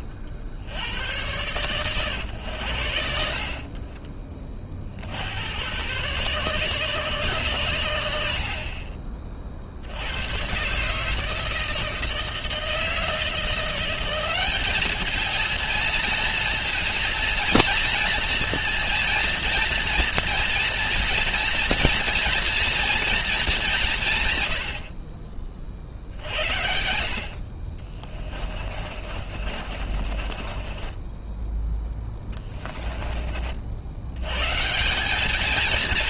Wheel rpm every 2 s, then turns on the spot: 80, 90, 40, 140, 40, 140, 160, 210, 230, 230, 230, 230, 60, 60, 40, 30, 20, 160.
28-34